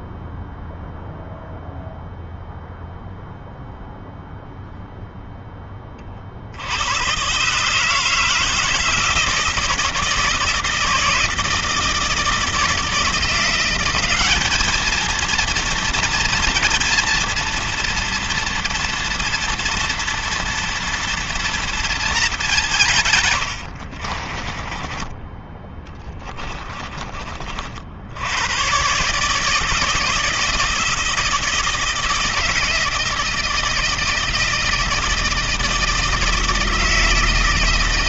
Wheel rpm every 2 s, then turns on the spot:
0, 0, 0, 70, 160, 160, 160, 210, 240, 240, 240, 200, 30, 20, 110, 160, 160, 160, 170.
24-28